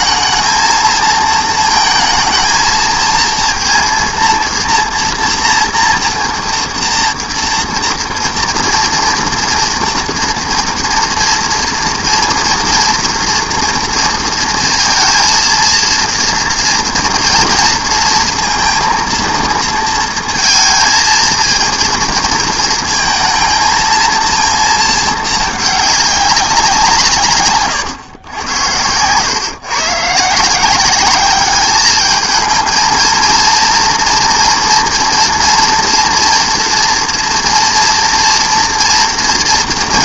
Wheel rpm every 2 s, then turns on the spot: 230, 230, 240, 240, 230, 240, 230, 230, 230, 230, 230, 230, 230, 190, 100, 180, 230, 230, 230, 230.
none